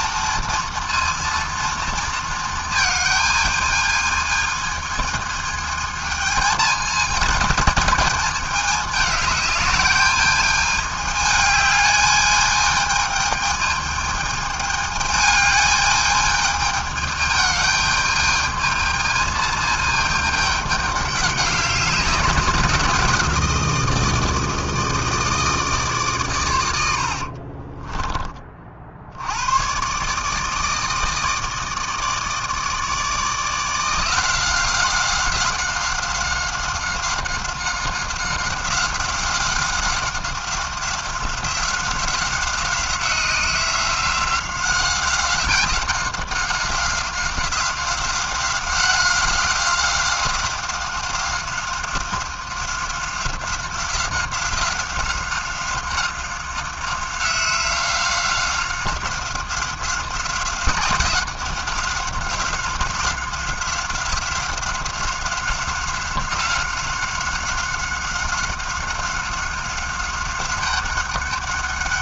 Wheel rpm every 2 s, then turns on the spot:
230, 220, 220, 220, 210, 210, 220, 210, 210, 220, 200, 170, 160, 50, 80, 160, 160, 180, 190, 190, 190, 190, 190, 180, 190, 190, 180, 190, 190, 190, 190, 180, 180, 190, 190, 190.
26-28